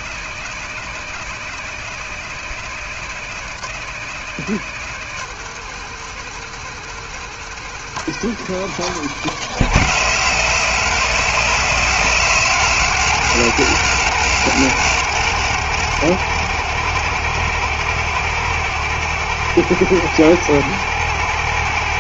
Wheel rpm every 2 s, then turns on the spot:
160, 160, 160, 160, 170, 150, 150, 150, 160, 160, 160.
none